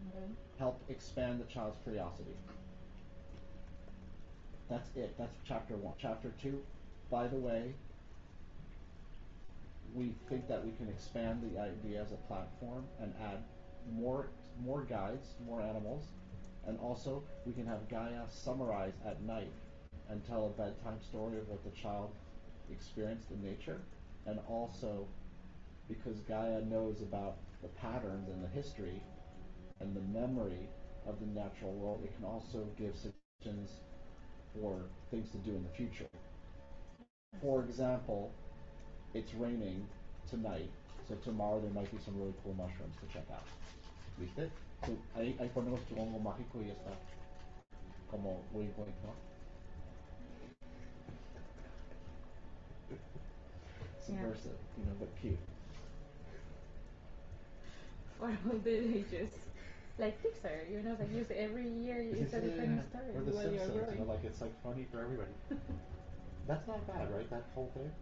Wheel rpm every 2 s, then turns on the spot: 0, 0, 0, 0, 0, 0, 0, 0, 0, 0, 0, 0, 0, 0, 0, 0, 0, 0, 0, 0, 0, 0, 0, 0, 0, 0, 0, 0, 0, 0, 0, 0, 0, 0.
none